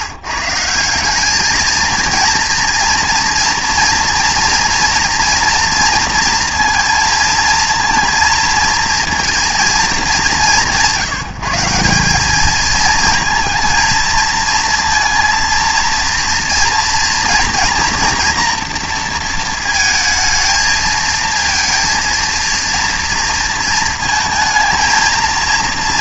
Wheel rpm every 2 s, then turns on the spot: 180, 230, 240, 230, 230, 180, 220, 230, 240, 230, 220, 230, 230.
none